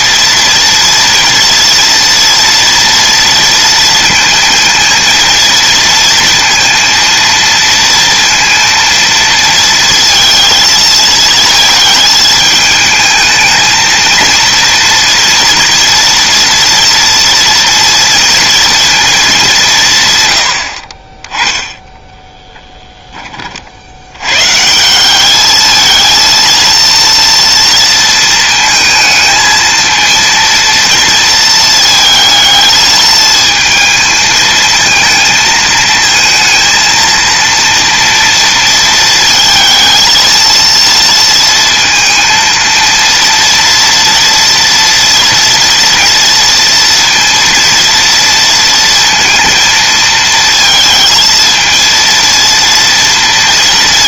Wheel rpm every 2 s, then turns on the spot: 230, 230, 230, 230, 230, 220, 220, 240, 230, 230, 30, 20, 200, 230, 220, 230, 220, 220, 230, 220, 230, 230, 230, 230, 230, 230, 230.
none